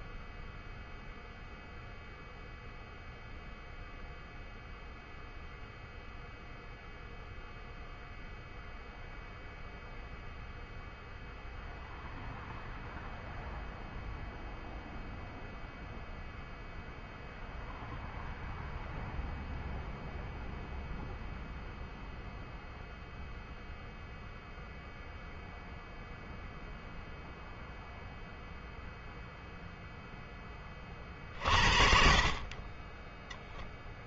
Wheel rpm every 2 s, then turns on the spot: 0, 0, 0, 0, 0, 0, 0, 0, 0, 0, 0, 0, 0, 0, 0, 20, 30.
none